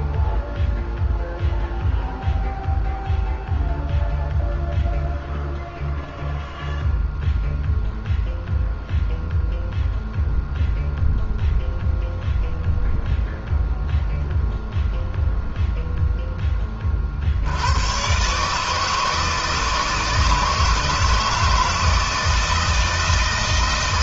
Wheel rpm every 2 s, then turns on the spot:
0, 0, 0, 0, 0, 0, 0, 0, 20, 150, 160, 160.
none